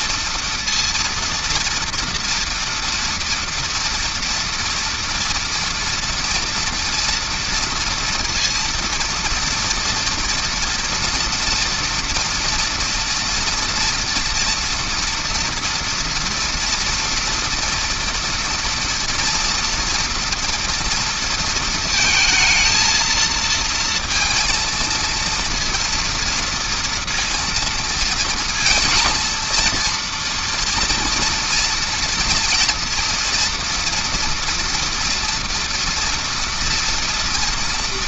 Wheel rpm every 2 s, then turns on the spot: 230, 230, 230, 230, 230, 230, 230, 230, 230, 230, 230, 220, 230, 230, 230, 230, 230, 230, 230.
none